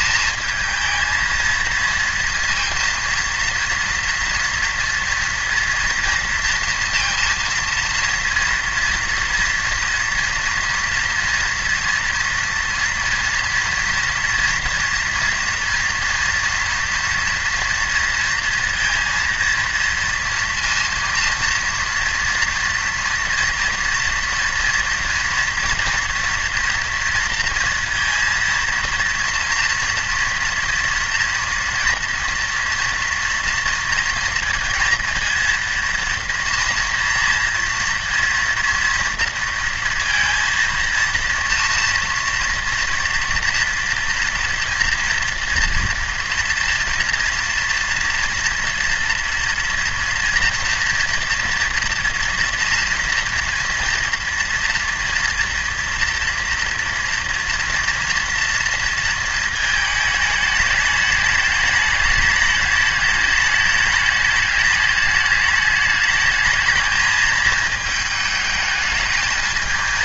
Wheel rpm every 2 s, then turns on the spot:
220, 230, 230, 230, 230, 230, 230, 230, 230, 230, 230, 230, 240, 230, 230, 230, 230, 230, 230, 230, 230, 230, 230, 240, 240, 230, 240, 230, 230, 230, 210, 210, 210, 210, 220.
none